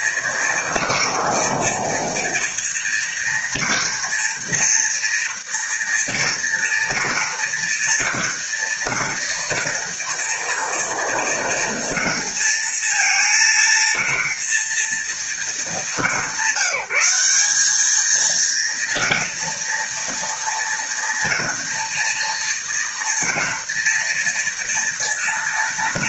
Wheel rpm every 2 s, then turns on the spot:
230, 230, 230, 230, 230, 230, 230, 230, 190, 230, 230, 230, 230.
none